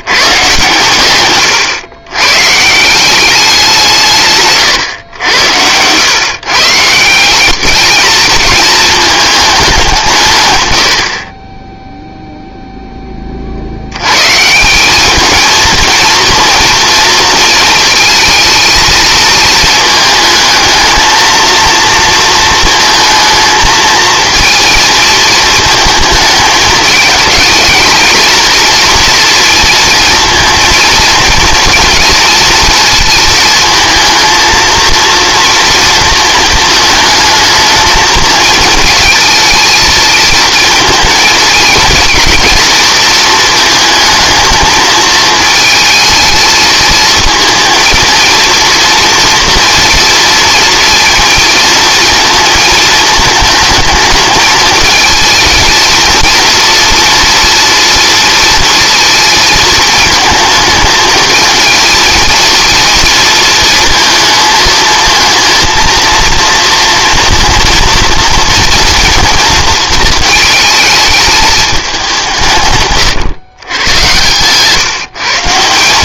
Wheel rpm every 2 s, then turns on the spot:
130, 150, 130, 150, 220, 120, 0, 170, 230, 220, 220, 220, 230, 220, 230, 230, 230, 230, 220, 230, 230, 230, 220, 220, 230, 230, 220, 220, 230, 230, 220, 230, 220, 230, 230, 220, 140, 130.
none